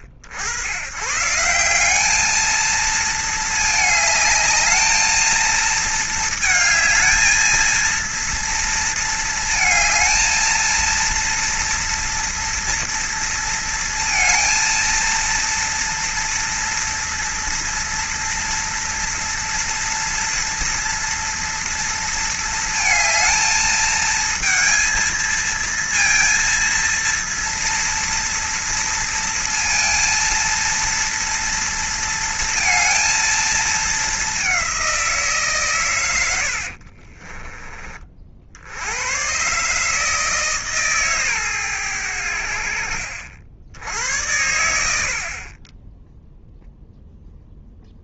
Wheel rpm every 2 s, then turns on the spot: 90, 220, 210, 220, 230, 220, 230, 230, 230, 230, 230, 230, 230, 230, 230, 230, 230, 200, 80, 70, 150, 70, 90, 0.
36-38